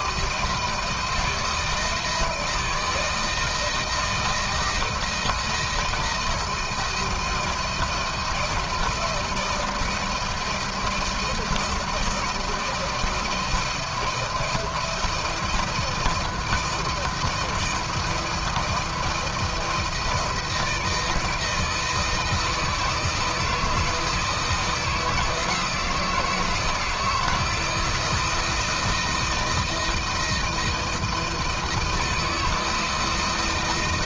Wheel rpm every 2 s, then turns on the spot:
160, 160, 170, 170, 160, 160, 160, 170, 160, 170, 160, 160, 160, 160, 160, 160, 160.
none